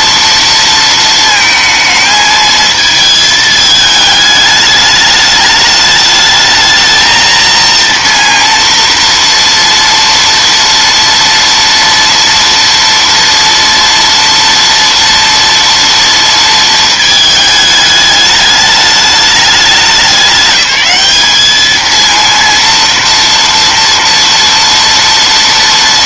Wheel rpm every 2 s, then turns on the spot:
230, 220, 210, 220, 230, 230, 230, 230, 230, 210, 200, 230, 230.
none